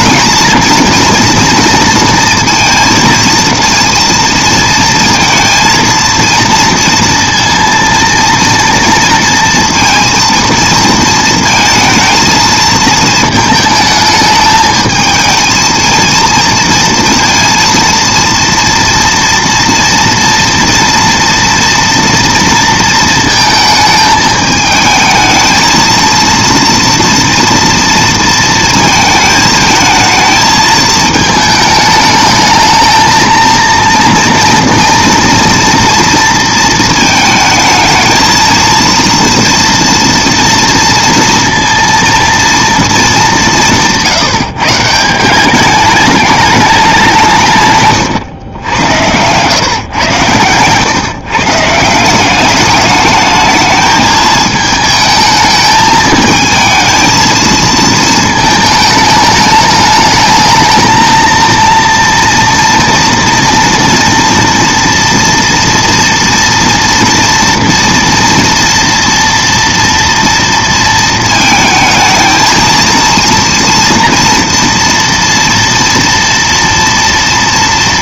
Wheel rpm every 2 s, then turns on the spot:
230, 230, 230, 230, 230, 230, 220, 220, 230, 230, 230, 230, 220, 230, 220, 220, 220, 230, 220, 230, 230, 210, 160, 190, 100, 130, 210, 220, 220, 210, 220, 230, 230, 230, 230, 230, 230, 230, 230.
48-50